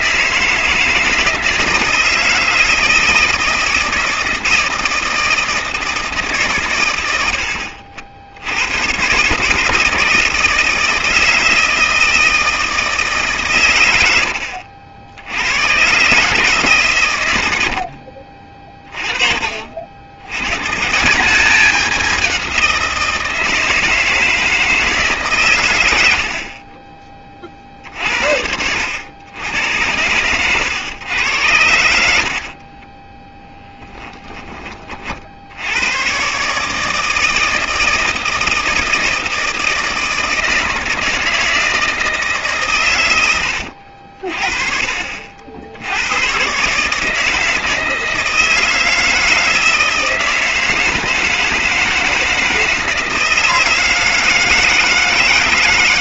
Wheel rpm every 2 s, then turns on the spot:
160, 160, 160, 110, 110, 160, 160, 70, 130, 30, 150, 170, 160, 30, 80, 110, 20, 30, 160, 160, 160, 120, 40, 150, 160, 160, 160, 160.
32-34